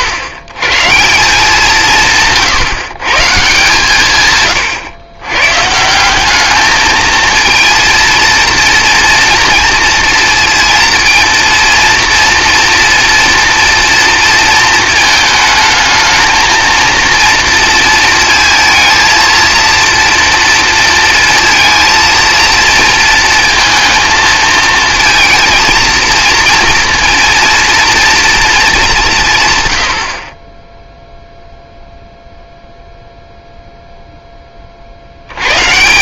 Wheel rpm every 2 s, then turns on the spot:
150, 130, 100, 210, 230, 230, 230, 220, 230, 230, 230, 230, 220, 230, 200, 10, 0, 30.
none